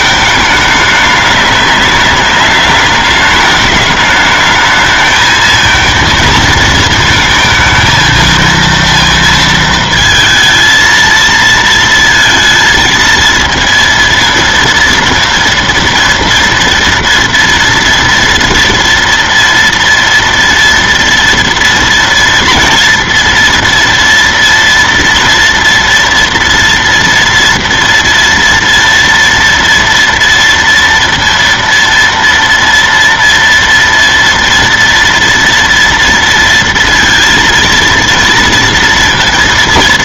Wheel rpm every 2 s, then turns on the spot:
210, 210, 220, 230, 230, 230, 220, 230, 230, 230, 230, 230, 230, 230, 230, 230, 230, 230, 230, 230.
none